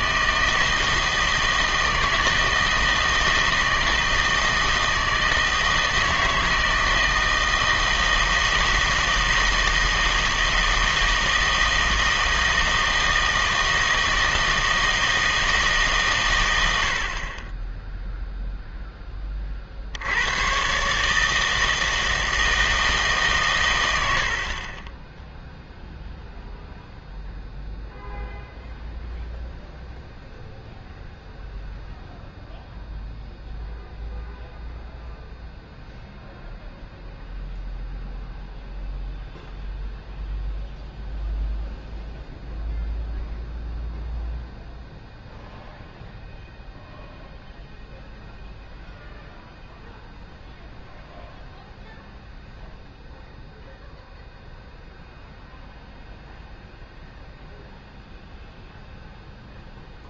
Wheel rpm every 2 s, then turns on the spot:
160, 160, 160, 160, 160, 160, 160, 160, 80, 0, 130, 160, 30, 0, 0, 0, 0, 0, 0, 0, 0, 0, 0, 0, 0, 0, 0, 0, 0, 0.
none